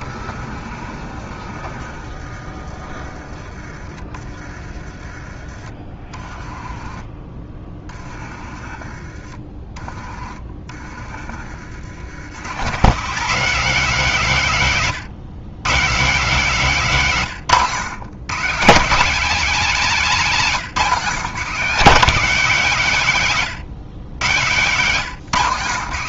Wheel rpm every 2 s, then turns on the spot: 50, 40, 40, 30, 40, 40, 190, 150, 170, 210, 190, 180, 160.
none